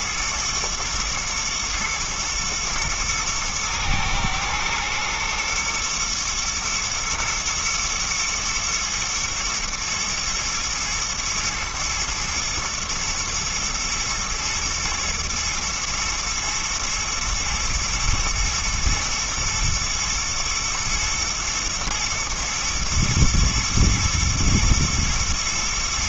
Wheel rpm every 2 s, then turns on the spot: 110, 110, 110, 120, 120, 120, 110, 110, 110, 110, 110, 110, 110.
none